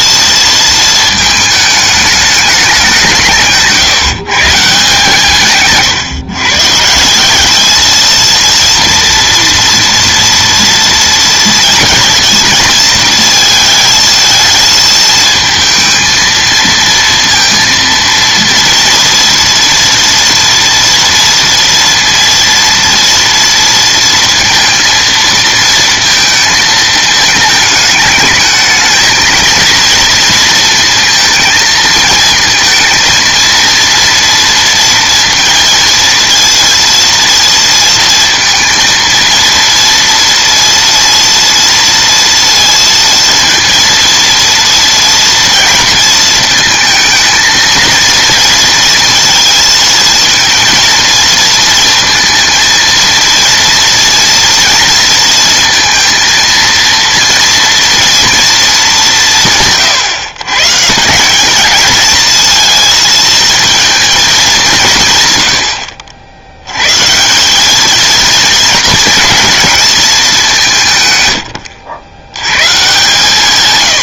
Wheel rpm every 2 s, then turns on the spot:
230, 180, 150, 150, 230, 230, 230, 220, 230, 230, 230, 230, 230, 220, 220, 230, 230, 230, 230, 230, 230, 230, 230, 230, 230, 230, 230, 230, 230, 210, 150, 230, 160, 110, 220, 150, 140.
none